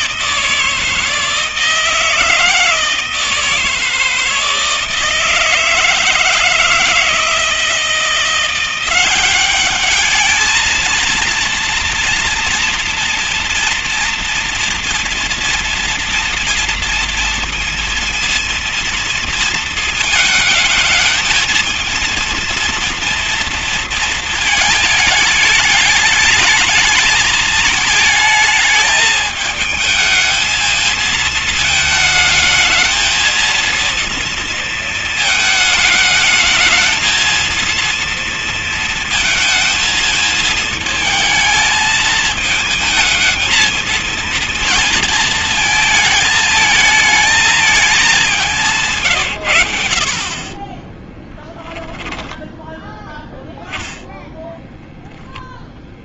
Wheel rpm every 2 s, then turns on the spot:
160, 160, 160, 160, 180, 230, 230, 230, 230, 230, 220, 230, 220, 210, 210, 220, 220, 230, 220, 230, 220, 220, 230, 220, 170, 30, 10, 0.
50-52